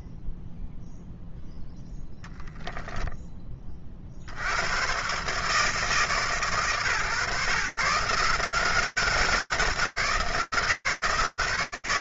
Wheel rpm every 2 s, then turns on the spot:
0, 0, 100, 130, 170, 180.
none